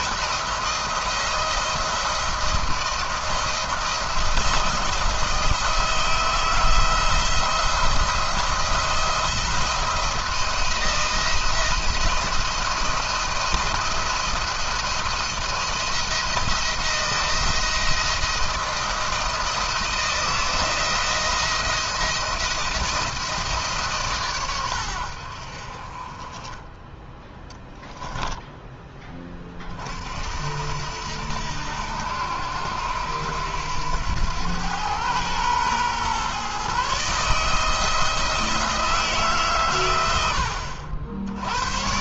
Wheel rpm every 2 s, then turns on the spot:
160, 170, 170, 160, 170, 160, 170, 170, 170, 170, 160, 170, 110, 20, 10, 70, 90, 110, 140, 160, 70.
none